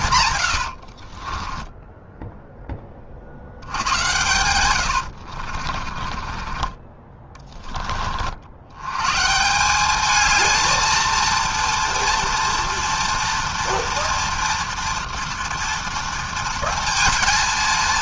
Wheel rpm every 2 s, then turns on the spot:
100, 10, 100, 20, 70, 220, 230, 230, 230.
0-2 4-8